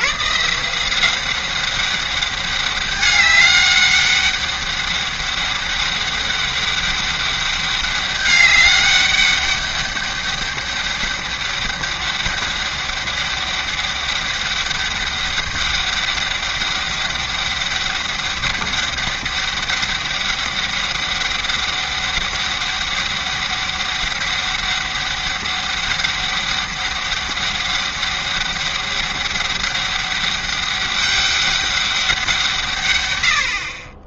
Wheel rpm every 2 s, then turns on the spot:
170, 200, 200, 200, 200, 200, 200, 200, 200, 200, 200, 200, 200, 200, 200, 200, 140.
none